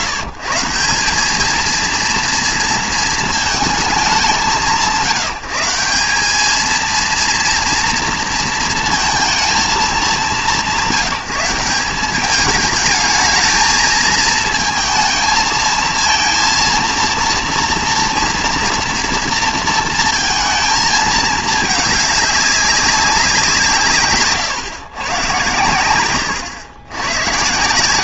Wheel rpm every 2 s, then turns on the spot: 150, 230, 160, 220, 230, 180, 210, 230, 230, 230, 220, 200, 120, 120.
none